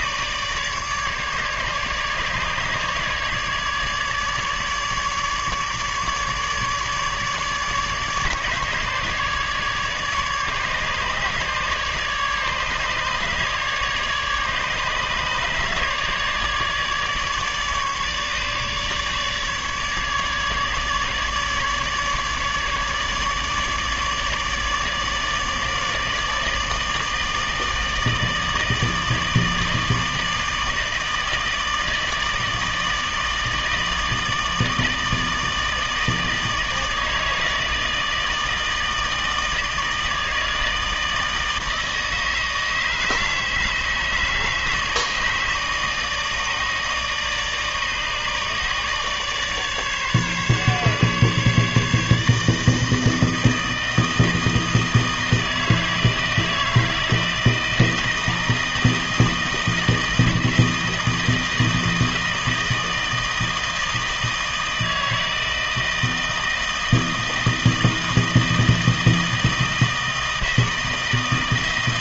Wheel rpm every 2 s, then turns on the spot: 150, 150, 150, 150, 150, 150, 150, 150, 150, 150, 150, 150, 150, 160, 160, 160, 160, 160, 160, 160, 160, 160, 150, 150, 150, 140, 160, 160, 160, 160, 160, 160, 160, 160, 160, 160.
none